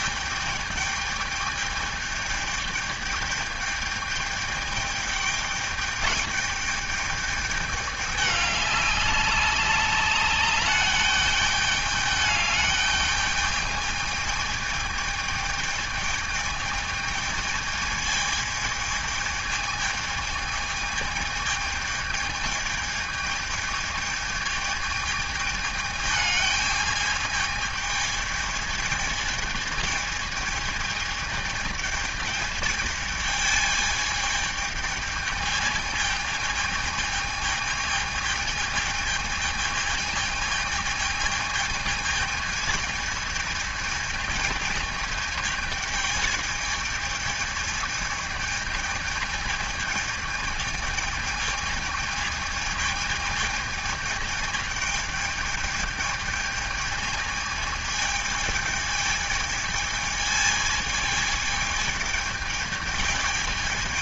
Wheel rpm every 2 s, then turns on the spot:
210, 210, 210, 210, 200, 210, 210, 210, 220, 220, 210, 220, 220, 220, 220, 220, 210, 220, 220, 220, 220, 220, 220, 220, 220, 220, 220, 220, 220, 210, 220, 210.
none